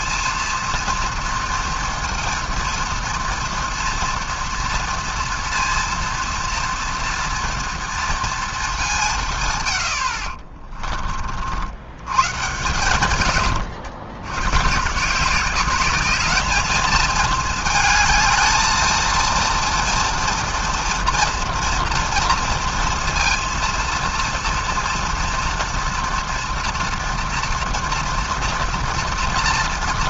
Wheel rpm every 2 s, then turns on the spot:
230, 230, 230, 230, 220, 40, 130, 120, 210, 220, 230, 230, 230, 230, 230.
10-12